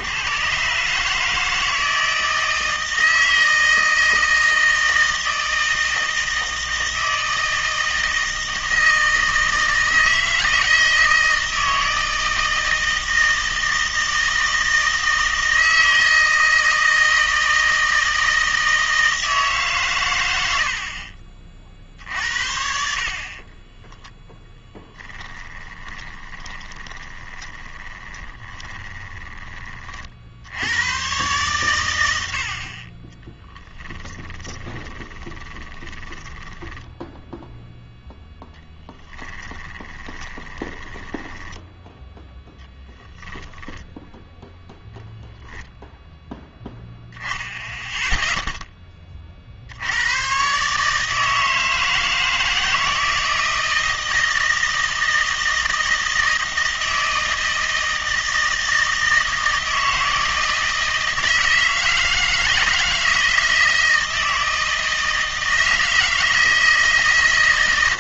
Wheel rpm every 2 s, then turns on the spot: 130, 160, 160, 160, 160, 160, 160, 160, 160, 160, 80, 50, 10, 10, 10, 90, 50, 20, 10, 10, 10, 10, 0, 10, 10, 140, 160, 160, 160, 160, 160, 160, 160, 170.
24-30 34-38 40-42